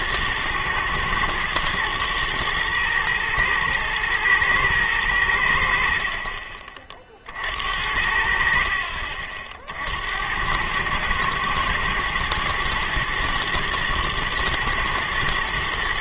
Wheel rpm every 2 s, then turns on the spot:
120, 120, 110, 40, 60, 100, 110, 120.
none